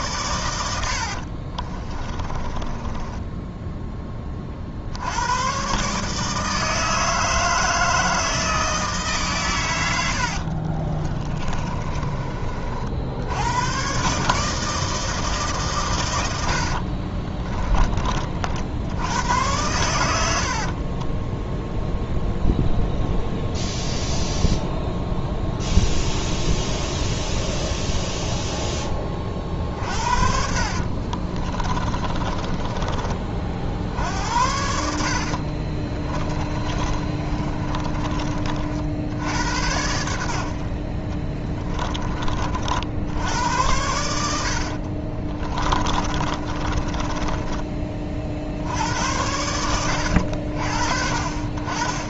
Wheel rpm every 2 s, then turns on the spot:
90, 20, 60, 160, 160, 30, 60, 160, 60, 70, 50, 0, 0, 0, 10, 40, 30, 70, 30, 60, 40, 70, 50, 30, 80, 50.
0-4 10-12 16-18 20-22 30-34 36-38 44-48